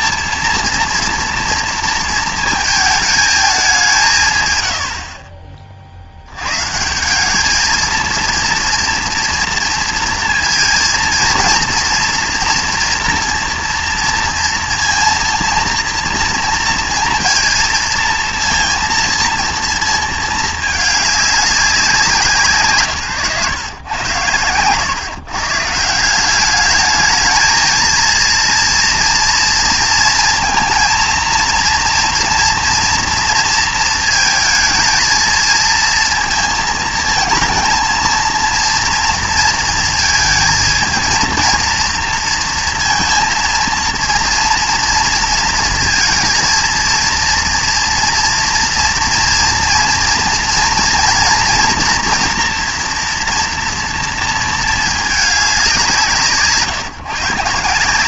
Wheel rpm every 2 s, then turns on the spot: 230, 220, 100, 130, 230, 230, 230, 230, 230, 230, 220, 140, 110, 210, 230, 230, 230, 220, 230, 230, 230, 230, 230, 230, 230, 230, 230, 220, 150.
none